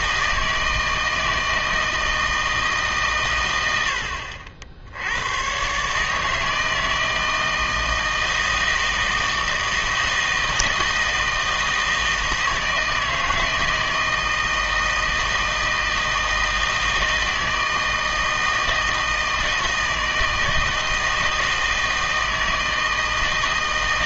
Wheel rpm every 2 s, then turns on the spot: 160, 160, 70, 160, 160, 160, 160, 160, 160, 160, 160, 160.
none